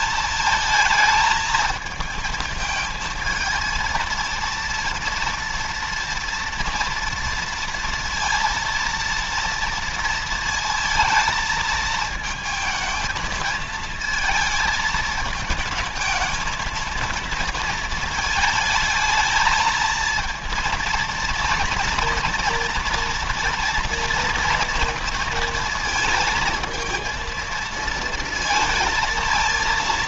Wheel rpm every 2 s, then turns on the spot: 220, 220, 230, 230, 230, 220, 220, 220, 230, 220, 230, 230, 230, 220, 230.
none